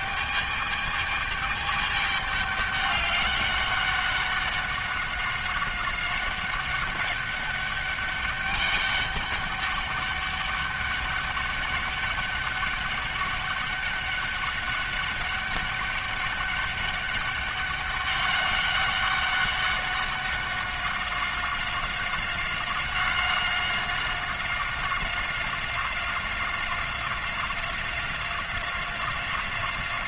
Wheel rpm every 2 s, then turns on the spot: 210, 200, 200, 200, 200, 200, 200, 200, 200, 200, 190, 190, 190, 180, 180.
none